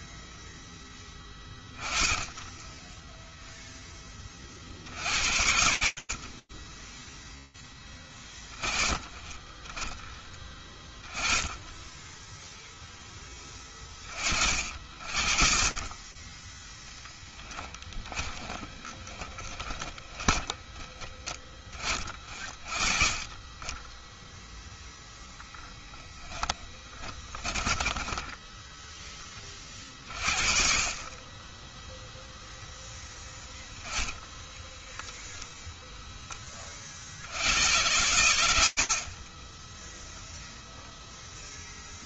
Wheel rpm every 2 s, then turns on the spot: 10, 10, 60, 10, 30, 20, 20, 50, 10, 10, 20, 20, 10, 20, 30, 10, 0, 0, 100, 10, 0.
2-4 16-20 26-28 38-40